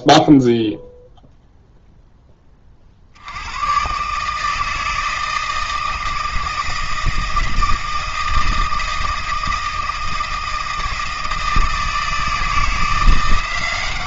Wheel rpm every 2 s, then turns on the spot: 0, 50, 160, 160, 160, 160, 170.
none